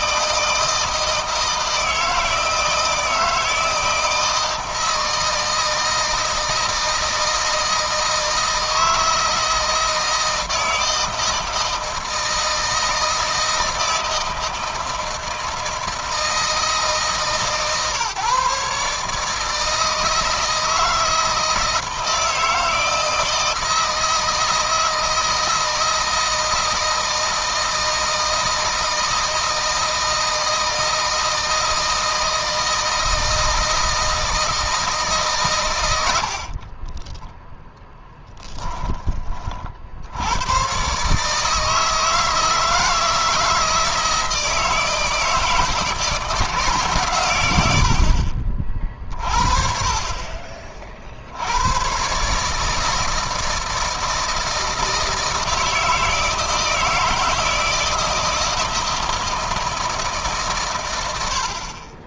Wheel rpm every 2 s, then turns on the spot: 160, 160, 160, 160, 160, 160, 160, 160, 160, 150, 160, 160, 160, 160, 160, 160, 160, 160, 30, 20, 120, 160, 160, 150, 40, 40, 150, 160, 160, 160, 120.
36-40